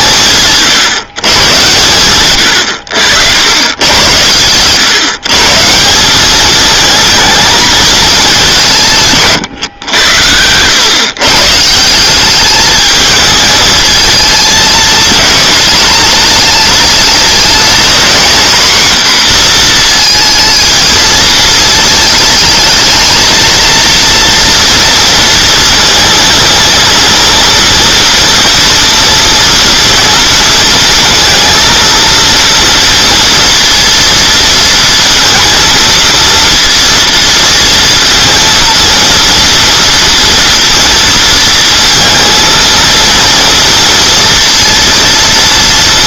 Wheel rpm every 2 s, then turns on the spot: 150, 120, 120, 220, 180, 100, 210, 230, 220, 240, 220, 220, 230, 230, 230, 230, 230, 230, 230, 230, 230, 230, 230.
none